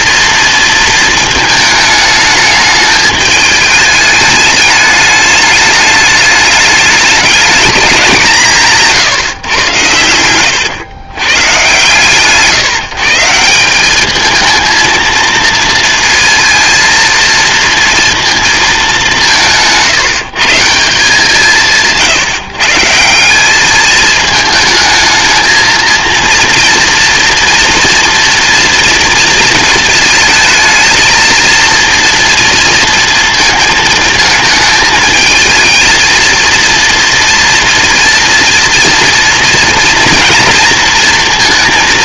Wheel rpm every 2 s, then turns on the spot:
220, 210, 210, 210, 150, 120, 150, 230, 230, 190, 170, 170, 220, 230, 230, 230, 230, 220, 230, 230, 230.
none